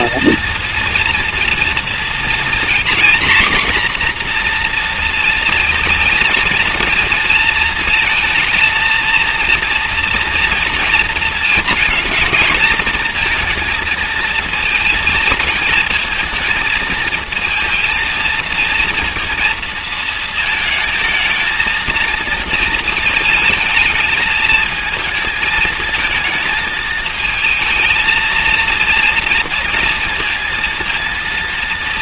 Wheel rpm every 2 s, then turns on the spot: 230, 240, 240, 230, 220, 230, 220, 230, 220, 230, 220, 220, 220, 220, 230, 230.
none